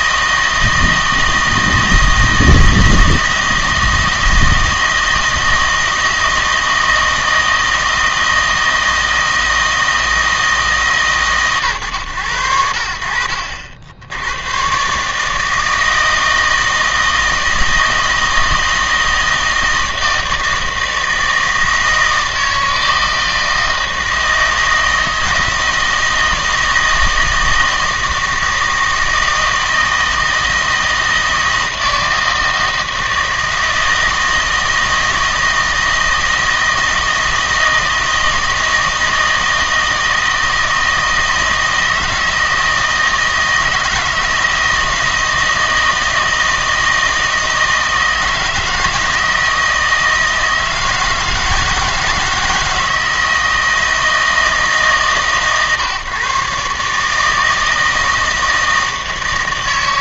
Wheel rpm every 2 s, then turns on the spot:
160, 160, 160, 160, 160, 150, 80, 120, 160, 160, 160, 160, 160, 160, 160, 160, 160, 160, 160, 160, 160, 160, 160, 160, 160, 160, 160, 160, 140, 160.
none